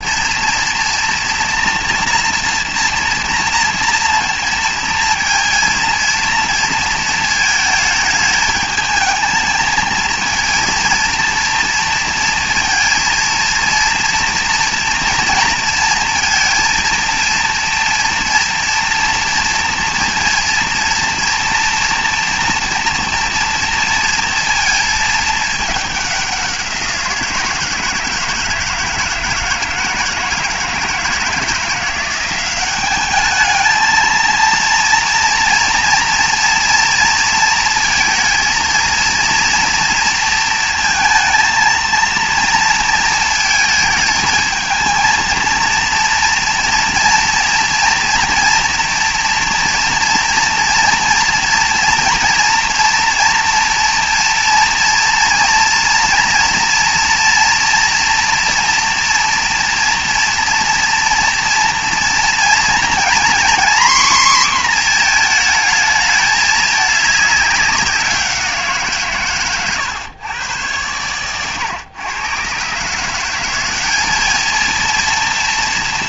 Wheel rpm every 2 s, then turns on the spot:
230, 230, 230, 230, 220, 230, 230, 230, 230, 230, 230, 230, 230, 180, 160, 160, 190, 230, 230, 230, 230, 230, 220, 230, 230, 230, 230, 230, 230, 230, 230, 230, 240, 210, 170, 110, 130, 220.
none